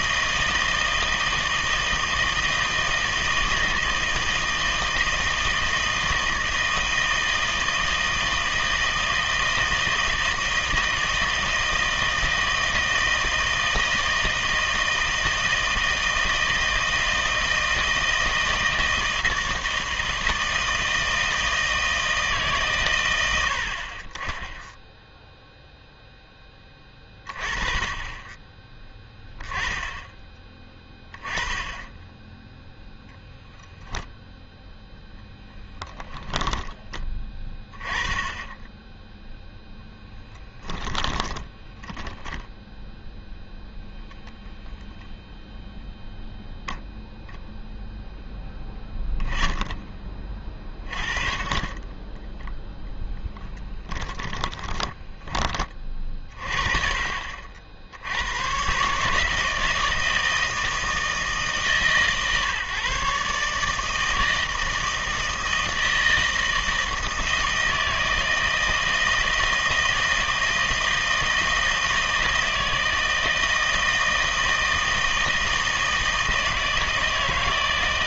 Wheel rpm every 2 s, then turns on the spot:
160, 160, 160, 160, 160, 160, 160, 160, 160, 160, 160, 140, 0, 10, 10, 20, 0, 0, 10, 10, 10, 0, 0, 0, 10, 30, 0, 20, 40, 120, 160, 140, 160, 160, 160, 160, 160, 160, 160.
40-42 54-56